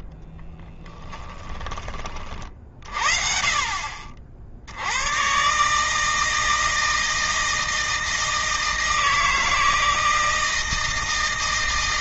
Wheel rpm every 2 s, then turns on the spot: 10, 50, 80, 160, 160, 160.
0-2